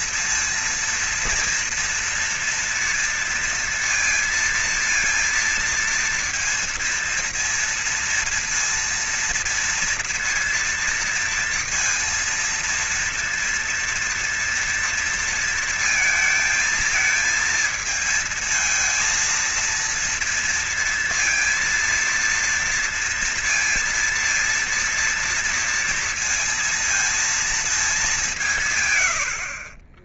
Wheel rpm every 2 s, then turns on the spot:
230, 230, 230, 230, 230, 230, 230, 230, 220, 230, 230, 230, 230, 230, 180.
none